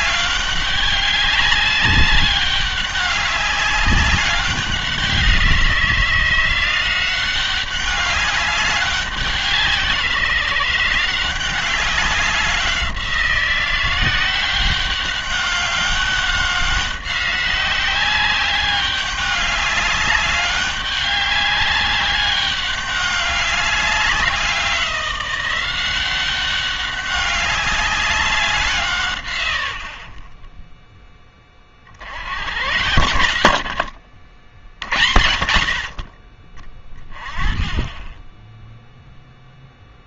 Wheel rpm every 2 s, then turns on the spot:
200, 200, 190, 180, 200, 170, 180, 200, 190, 200, 200, 200, 180, 200, 170, 10, 90, 50, 20, 0.
none